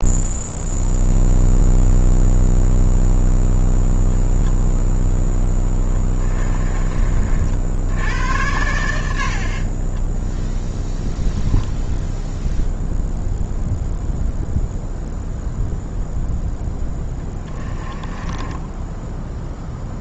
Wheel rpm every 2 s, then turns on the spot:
0, 0, 0, 30, 90, 10, 0, 0, 10, 10.
16-20